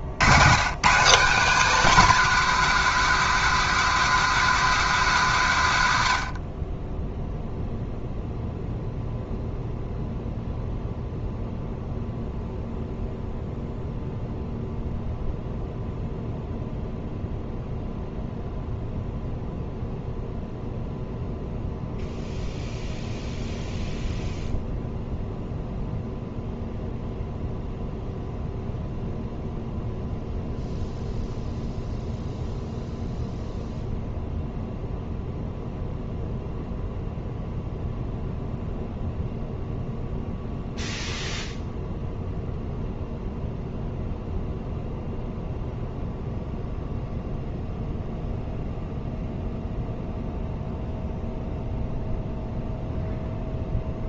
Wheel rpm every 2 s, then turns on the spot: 110, 250, 240, 60, 0, 0, 0, 0, 0, 0, 0, 0, 0, 0, 0, 0, 0, 0, 0, 0, 0, 0, 0, 0, 0, 0, 0.
none